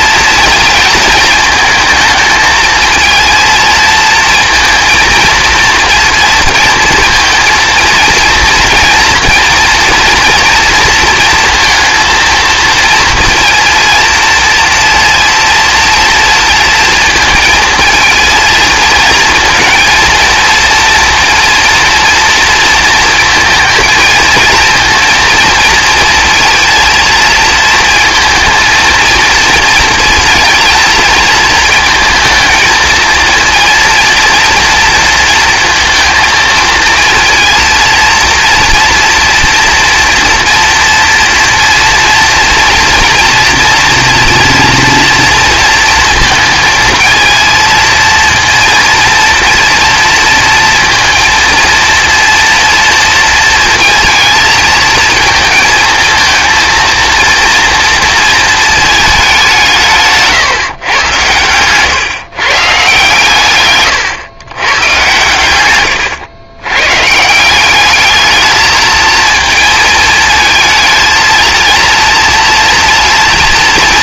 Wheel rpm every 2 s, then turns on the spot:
230, 220, 220, 230, 230, 230, 230, 230, 230, 230, 230, 230, 230, 230, 230, 230, 220, 240, 230, 230, 230, 230, 230, 230, 230, 230, 230, 220, 230, 220, 130, 140, 110, 120, 220, 230, 230.
none